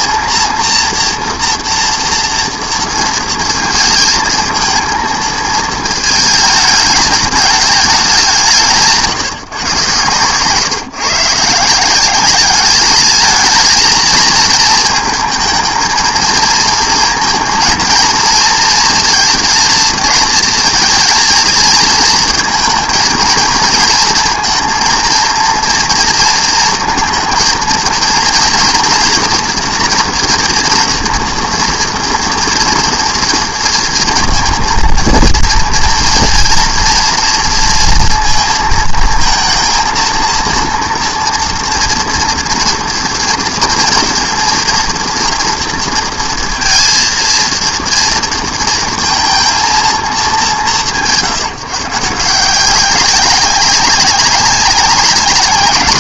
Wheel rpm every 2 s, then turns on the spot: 230, 230, 220, 210, 160, 140, 210, 230, 230, 230, 230, 230, 230, 230, 240, 230, 230, 230, 240, 230, 230, 230, 230, 230, 230, 160, 190, 200.
none